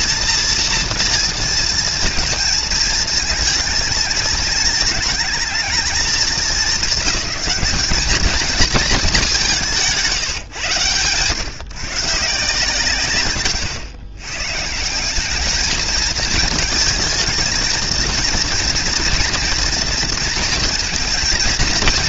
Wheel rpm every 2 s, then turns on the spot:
230, 220, 220, 210, 210, 120, 110, 180, 230, 230, 230.
10-12